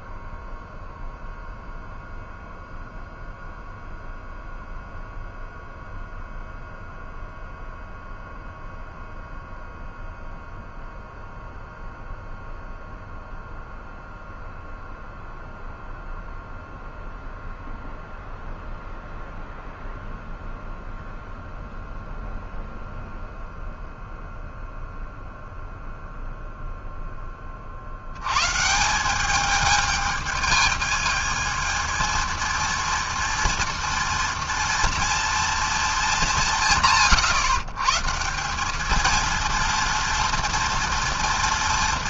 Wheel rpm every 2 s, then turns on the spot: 0, 0, 0, 0, 0, 0, 0, 0, 0, 0, 0, 0, 0, 20, 200, 220, 230, 230, 140, 230, 230.
none